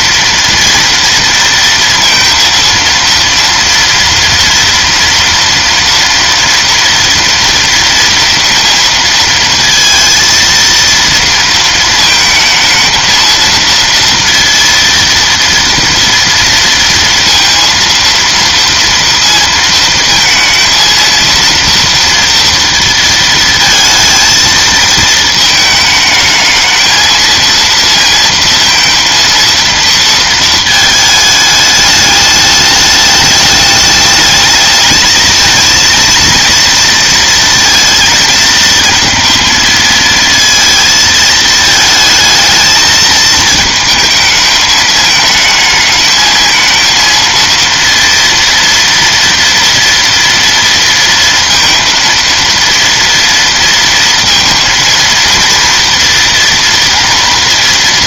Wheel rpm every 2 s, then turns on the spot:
230, 230, 230, 230, 230, 230, 230, 230, 230, 230, 230, 230, 230, 220, 230, 220, 210, 220, 230, 220, 230, 220, 220, 220, 230, 230, 230, 230, 240.
none